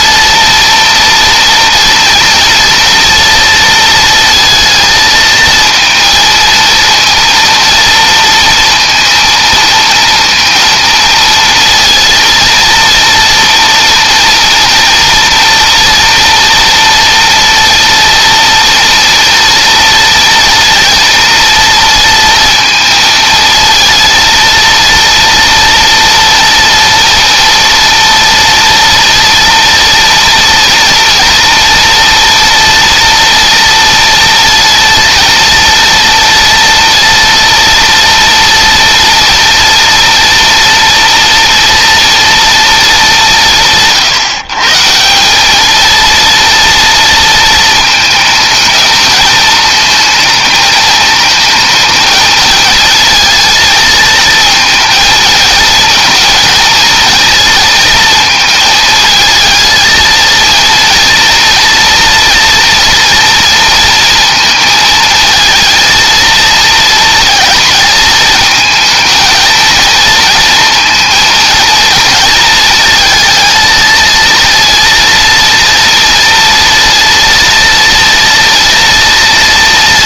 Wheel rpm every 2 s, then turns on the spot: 230, 230, 220, 230, 230, 230, 230, 230, 230, 230, 230, 220, 230, 230, 230, 240, 240, 230, 230, 230, 230, 200, 160, 230, 220, 220, 230, 220, 230, 220, 230, 230, 230, 230, 230, 230, 220, 230, 230, 240.
none